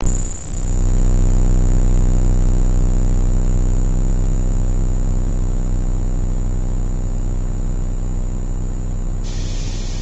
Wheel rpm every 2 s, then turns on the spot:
0, 0, 0, 0, 0.
none